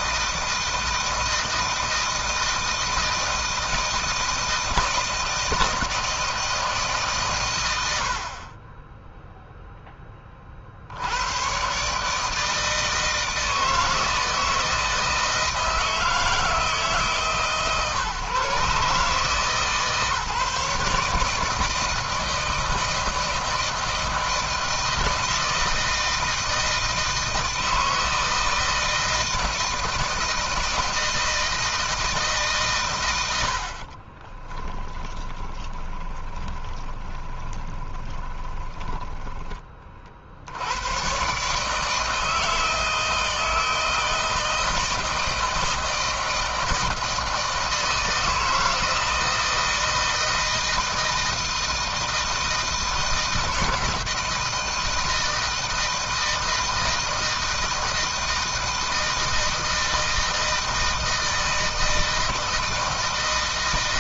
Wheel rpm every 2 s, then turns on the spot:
160, 160, 160, 160, 40, 40, 160, 160, 160, 140, 140, 160, 160, 160, 160, 160, 130, 20, 20, 10, 80, 160, 160, 160, 160, 160, 160, 160, 160, 160, 160, 160.
34-40